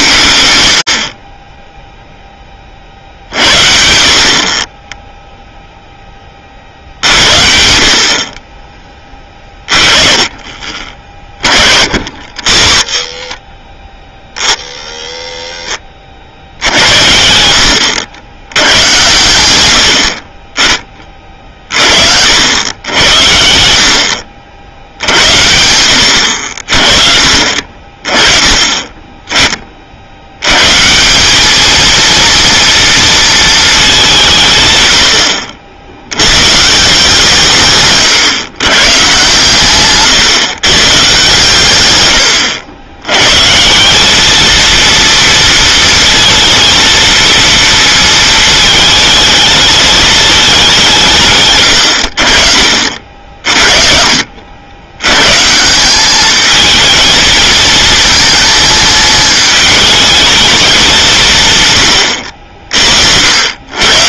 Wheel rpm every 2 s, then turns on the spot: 60, 50, 10, 50, 20, 30, 40, 50, 80, 100, 30, 90, 70, 50, 20, 120, 230, 130, 150, 120, 130, 90, 230, 230, 220, 200, 50, 80, 220, 220, 200, 50.
none